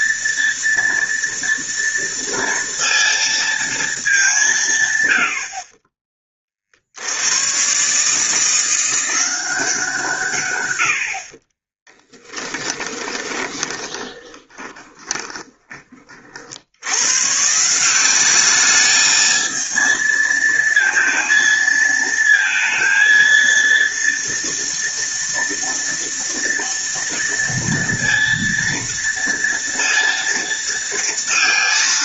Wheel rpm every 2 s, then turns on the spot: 230, 230, 180, 40, 170, 110, 10, 20, 70, 200, 230, 230, 230, 230, 230, 230.
12-16